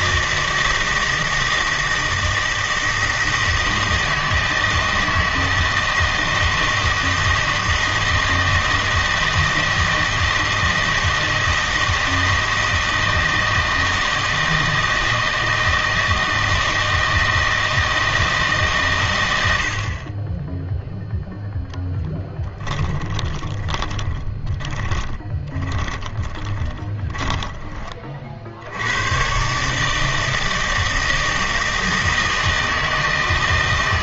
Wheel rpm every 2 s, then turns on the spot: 160, 160, 160, 160, 160, 160, 160, 160, 160, 130, 0, 10, 20, 20, 80, 160, 160.
22-28